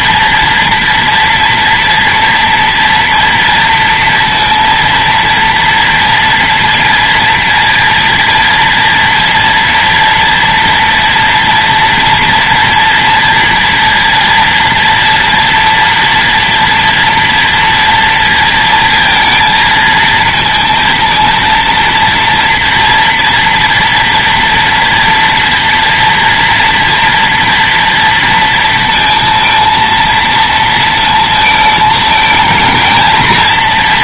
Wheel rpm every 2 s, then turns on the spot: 230, 230, 230, 230, 230, 240, 240, 230, 240, 230, 230, 230, 230, 230, 230, 230, 220.
none